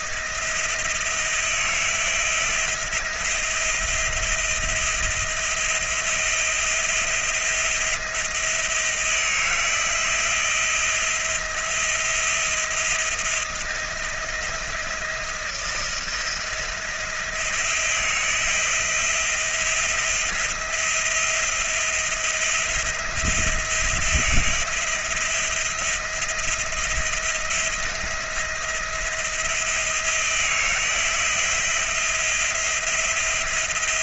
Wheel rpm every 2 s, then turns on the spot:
170, 170, 170, 170, 170, 170, 170, 170, 170, 170, 170, 170, 170, 170, 170, 160, 170.
none